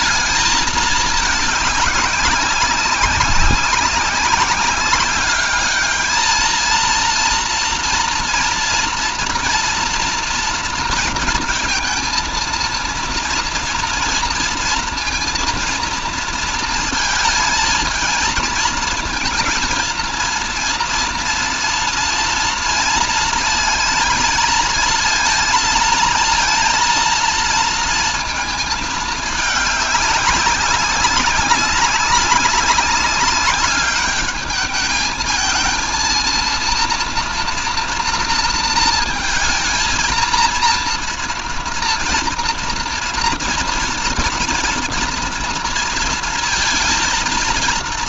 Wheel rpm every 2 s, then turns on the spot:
210, 190, 200, 230, 240, 230, 230, 240, 230, 220, 230, 230, 230, 230, 220, 190, 190, 220, 230, 230, 220, 230, 230, 230.
none